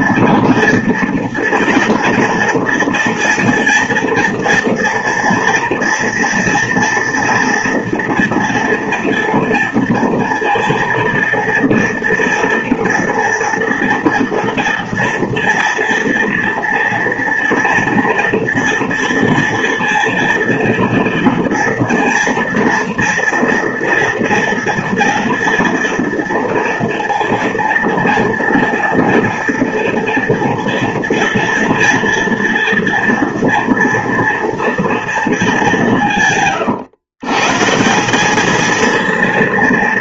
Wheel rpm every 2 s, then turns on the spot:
240, 230, 230, 230, 230, 230, 230, 230, 230, 230, 230, 230, 230, 240, 230, 230, 230, 230, 130, 230.
none